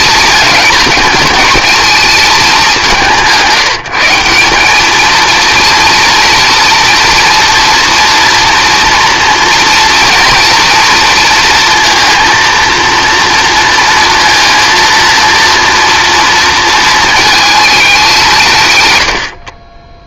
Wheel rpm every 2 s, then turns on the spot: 220, 190, 190, 230, 230, 230, 230, 230, 230, 160.
none